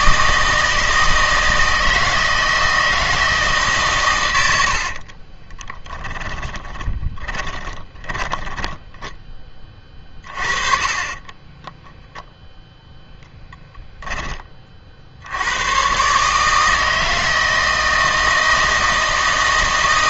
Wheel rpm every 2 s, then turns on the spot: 160, 160, 70, 10, 10, 30, 0, 40, 160, 160.
4-12